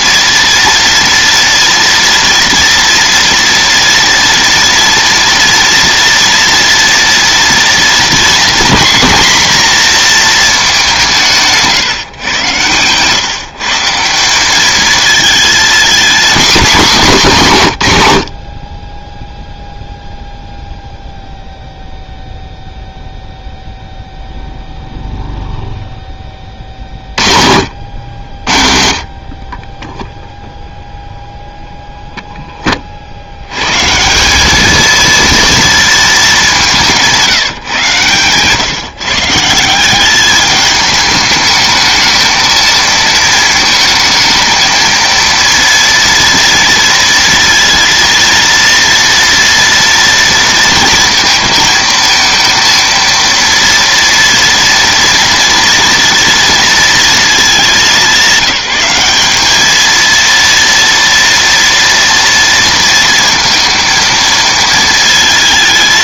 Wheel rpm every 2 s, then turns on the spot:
230, 230, 240, 230, 230, 200, 130, 210, 230, 30, 0, 0, 0, 40, 60, 0, 30, 220, 180, 140, 210, 230, 230, 230, 230, 230, 230, 230, 230, 200, 230, 230, 220.
none